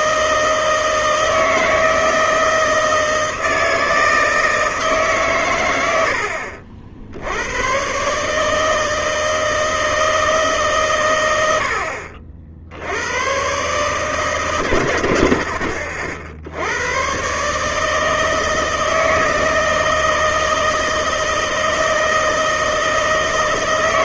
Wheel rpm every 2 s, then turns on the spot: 160, 160, 160, 60, 160, 130, 80, 110, 100, 160, 160, 160.
none